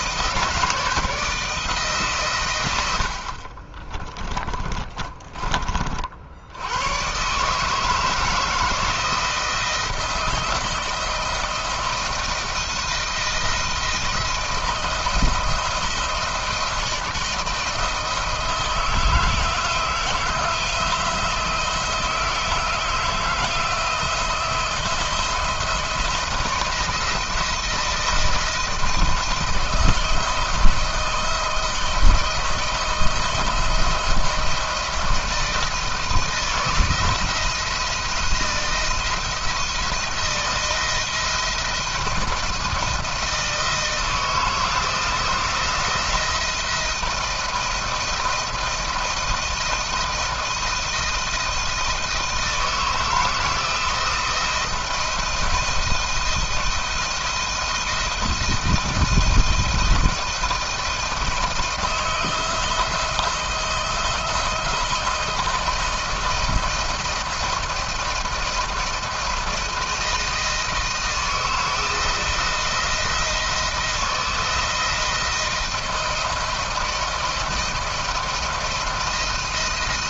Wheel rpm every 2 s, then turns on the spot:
160, 100, 30, 90, 160, 160, 170, 160, 160, 160, 170, 160, 170, 170, 170, 160, 160, 170, 170, 170, 170, 160, 160, 170, 160, 160, 160, 160, 160, 160, 160, 170, 170, 170, 170, 160, 170, 170, 160, 160.
4-6